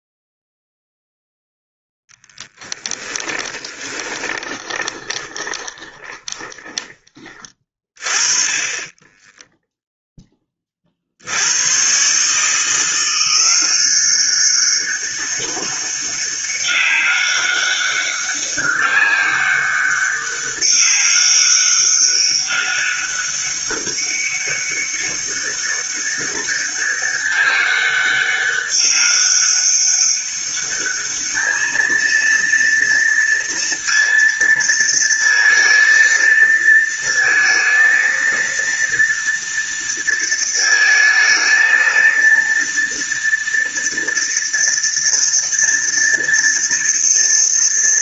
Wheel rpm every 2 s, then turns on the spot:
0, 10, 20, 20, 20, 50, 170, 200, 200, 200, 200, 200, 200, 200, 200, 210, 230, 230, 230, 230, 220, 230, 230, 230.
2-6